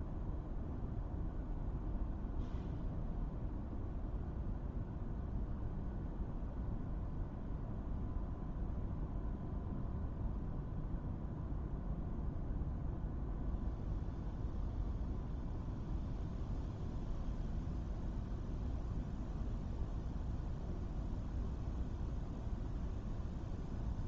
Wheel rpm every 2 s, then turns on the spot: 0, 0, 0, 0, 0, 0, 0, 0, 0, 0, 0, 0.
none